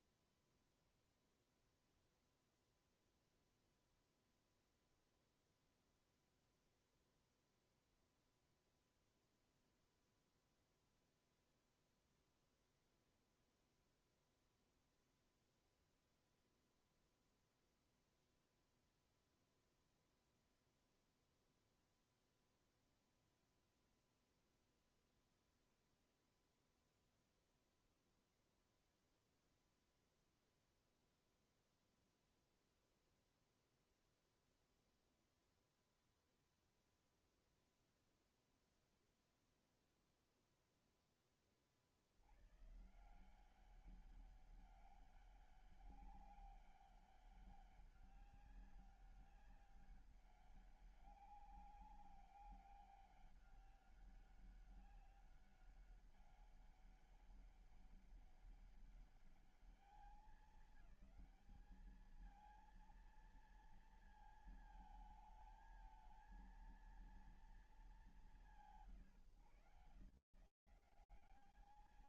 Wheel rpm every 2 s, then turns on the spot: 0, 0, 0, 0, 0, 0, 0, 0, 0, 0, 0, 0, 0, 0, 0, 0, 0, 0, 0, 0, 0, 110, 200, 200, 200, 200, 200, 200, 200, 200, 210, 220, 220, 220, 170, 150.
none